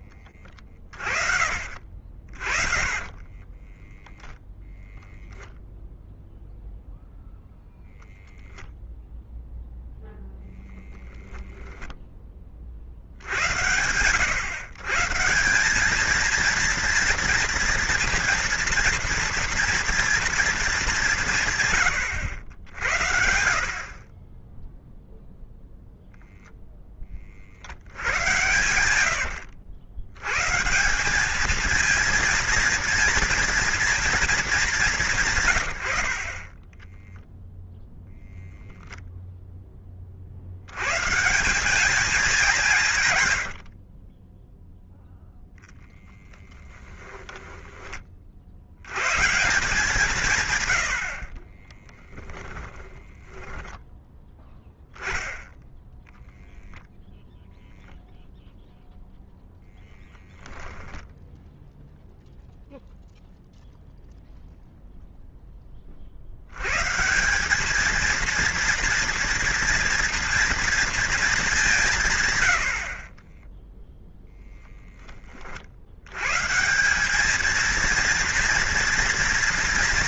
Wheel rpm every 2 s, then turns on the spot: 40, 40, 0, 0, 0, 0, 50, 130, 230, 230, 200, 80, 0, 10, 90, 180, 230, 190, 10, 0, 120, 160, 0, 10, 100, 100, 20, 10, 0, 0, 0, 0, 0, 140, 230, 230, 60, 10, 180, 230.
0-4 28-30 36-38 46-48 52-54